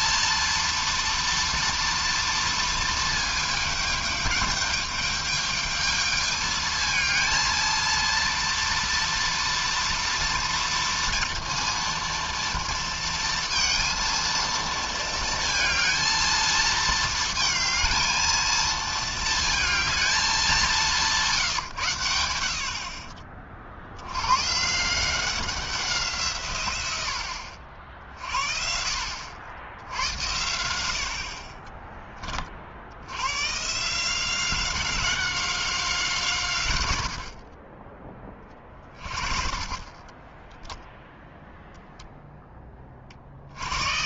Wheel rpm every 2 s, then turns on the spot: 230, 230, 210, 220, 230, 230, 230, 230, 220, 220, 200, 70, 140, 140, 40, 90, 40, 180, 140, 30, 10, 10.
40-42